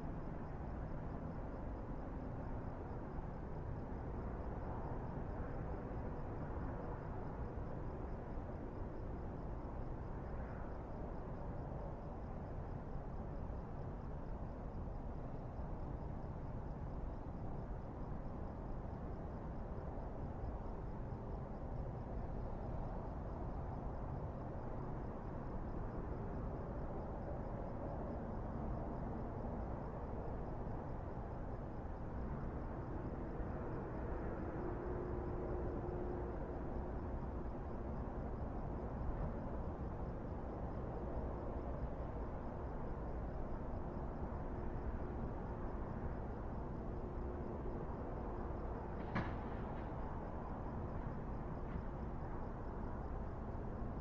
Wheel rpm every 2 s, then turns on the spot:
0, 0, 0, 0, 0, 0, 0, 0, 0, 0, 0, 0, 0, 0, 0, 0, 0, 0, 0, 0, 0, 0, 0, 0, 0, 0, 0.
none